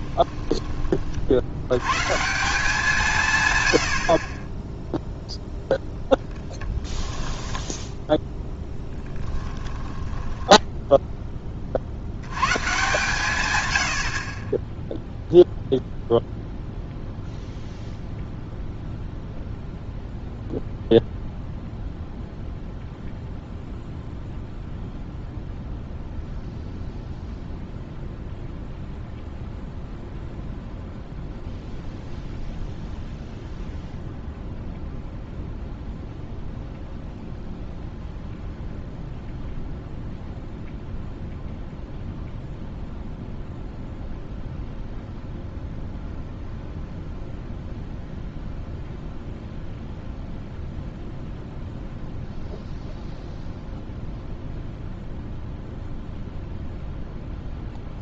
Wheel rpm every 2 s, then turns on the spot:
30, 160, 0, 10, 10, 10, 130, 0, 0, 0, 0, 0, 0, 0, 0, 0, 0, 0, 0, 0, 0, 0, 0, 0, 0, 0, 0, 0, 0.
6-10